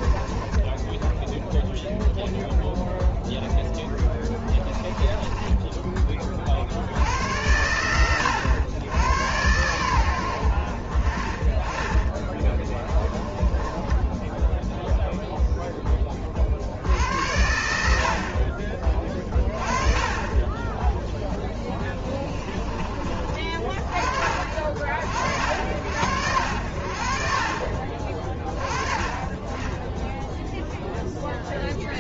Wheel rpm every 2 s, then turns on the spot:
10, 0, 20, 60, 100, 50, 10, 0, 70, 30, 10, 30, 50, 60, 30, 0.
4-6 12-14